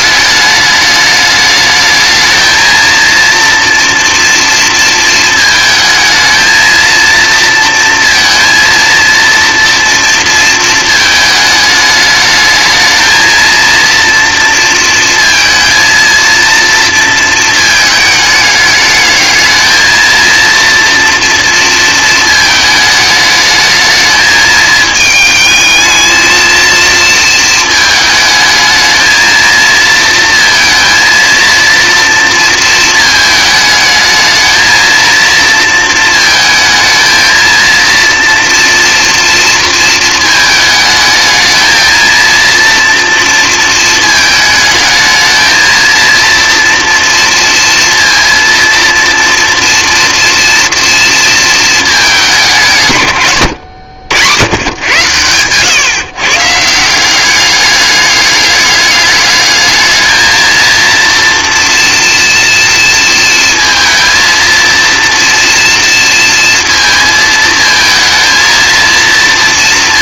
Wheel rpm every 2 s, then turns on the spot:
210, 220, 230, 230, 230, 230, 220, 230, 230, 210, 230, 220, 220, 230, 220, 230, 230, 220, 220, 240, 220, 230, 220, 230, 230, 230, 160, 110, 160, 210, 230, 230, 230, 230, 230.
none